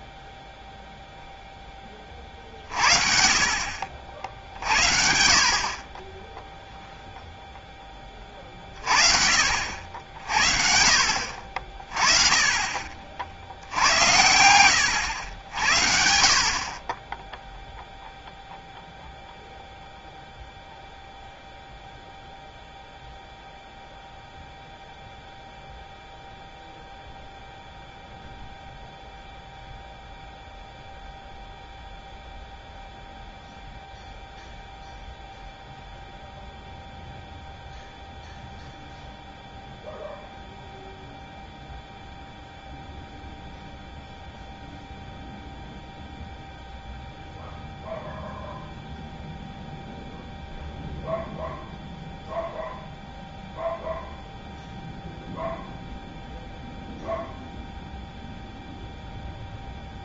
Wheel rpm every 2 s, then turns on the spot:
0, 50, 60, 0, 30, 60, 30, 90, 50, 0, 0, 0, 0, 0, 0, 0, 0, 0, 0, 0, 0, 0, 0, 0, 0, 0, 0, 0, 0, 0.
14-16